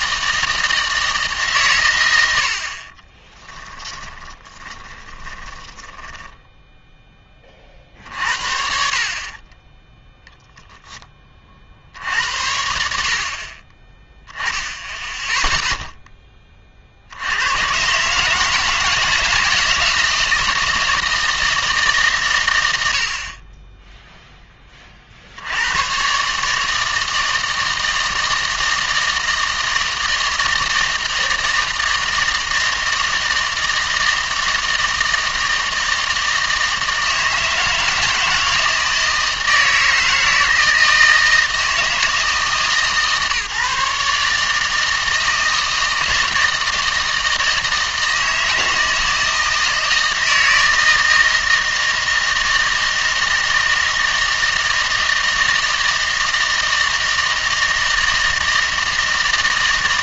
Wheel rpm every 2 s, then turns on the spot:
160, 50, 20, 0, 50, 0, 80, 10, 40, 160, 160, 120, 20, 150, 160, 160, 160, 160, 160, 160, 170, 150, 160, 160, 160, 160, 160, 160, 160, 160.
4-6